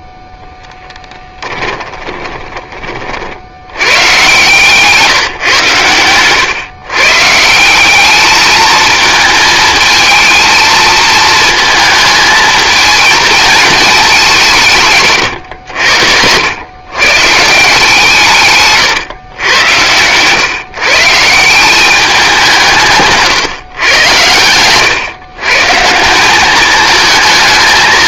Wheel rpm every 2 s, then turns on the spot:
0, 20, 120, 120, 210, 220, 220, 200, 90, 160, 120, 190, 100, 190.
2-4